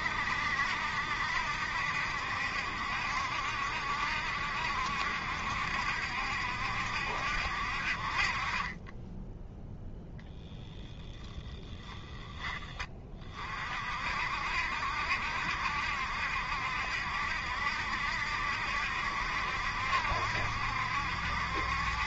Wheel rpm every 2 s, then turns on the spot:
70, 70, 70, 70, 30, 10, 20, 70, 70, 70, 70.
10-12